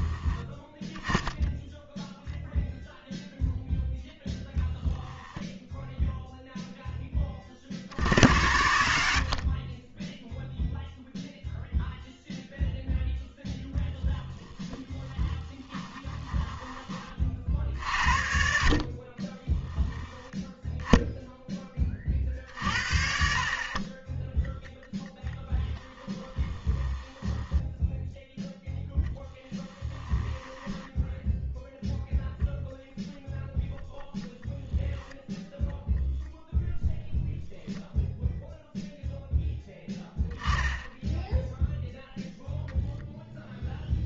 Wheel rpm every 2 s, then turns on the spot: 10, 0, 0, 0, 80, 0, 0, 10, 20, 60, 10, 50, 10, 10, 0, 10, 0, 0, 0, 0, 10, 0.
14-16 26-28 30-32